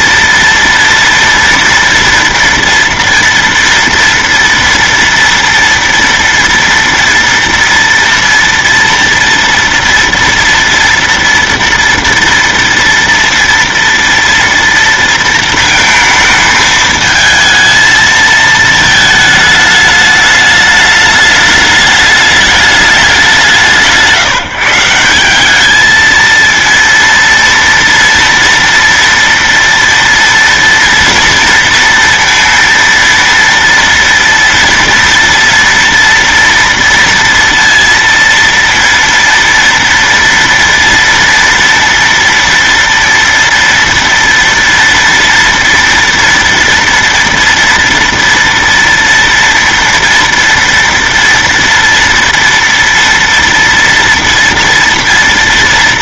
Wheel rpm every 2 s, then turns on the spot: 230, 230, 230, 230, 230, 230, 230, 230, 220, 220, 210, 210, 160, 230, 230, 230, 230, 240, 230, 230, 230, 230, 230, 230, 230, 230, 230, 230.
none